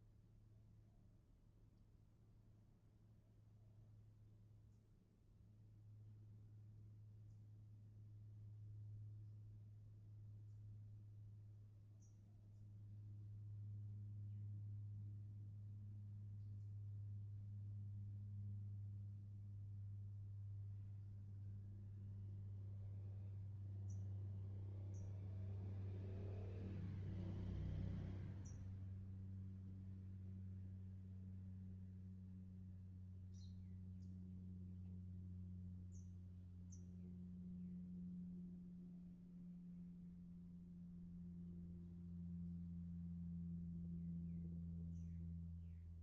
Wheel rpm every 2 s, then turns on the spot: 0, 0, 0, 0, 0, 0, 0, 0, 0, 0, 0, 0, 0, 0, 0, 0, 0, 0, 0, 0, 0, 0, 0.
none